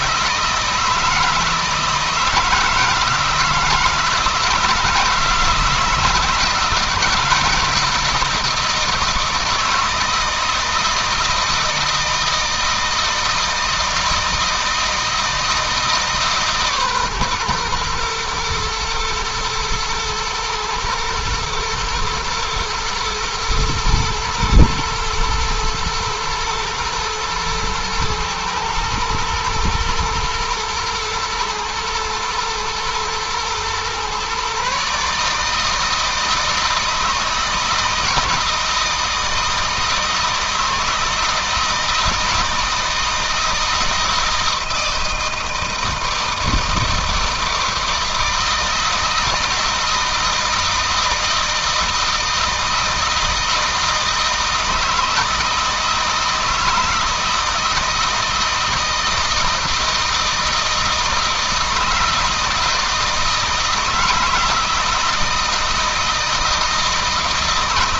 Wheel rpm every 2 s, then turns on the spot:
160, 160, 160, 160, 170, 160, 160, 160, 140, 120, 110, 120, 120, 110, 110, 120, 110, 140, 160, 160, 160, 160, 160, 160, 160, 160, 160, 160, 160, 160, 160, 160, 160, 160.
none